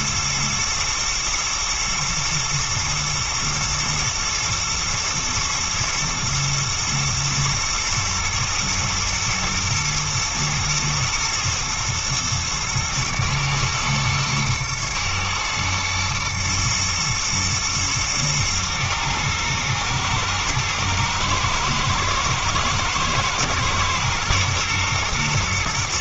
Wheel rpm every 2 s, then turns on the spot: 110, 120, 110, 110, 110, 110, 110, 110, 120, 120, 110, 110, 120.
none